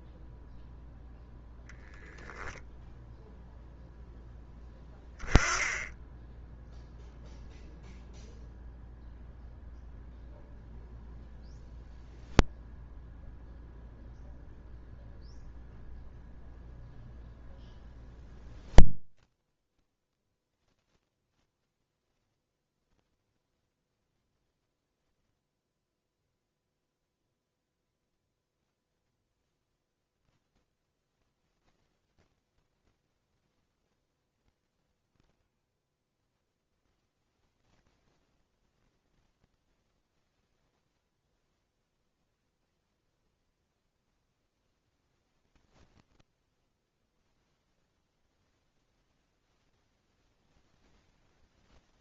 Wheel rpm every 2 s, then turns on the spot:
0, 10, 0, 0, 0, 0, 0, 0, 0, 0, 0, 0, 0, 0, 0, 0, 0, 10, 0, 0, 0, 0, 0, 0, 0, 10.
none